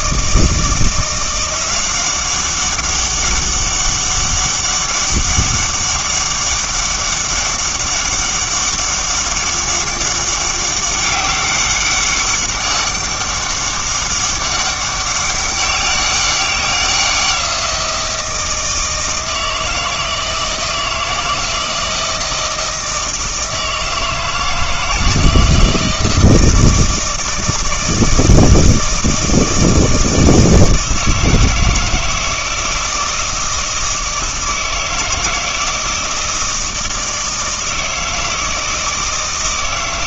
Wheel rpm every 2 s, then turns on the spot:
170, 190, 200, 200, 200, 200, 200, 200, 190, 160, 160, 160, 160, 160, 160, 160, 160, 160, 160, 160.
none